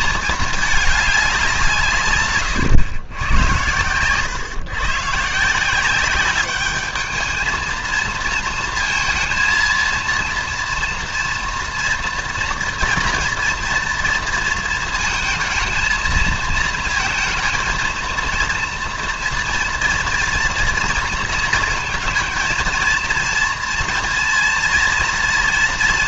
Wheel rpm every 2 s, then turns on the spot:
220, 120, 130, 200, 230, 230, 230, 230, 230, 230, 230, 230, 230.
none